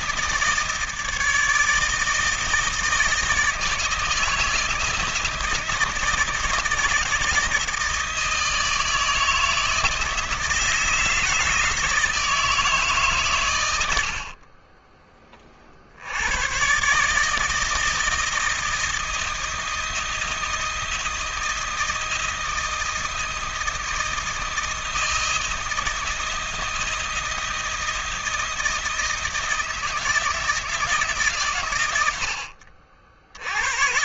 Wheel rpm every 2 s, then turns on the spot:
160, 160, 160, 160, 160, 160, 150, 20, 130, 160, 160, 160, 160, 170, 160, 160, 60.
none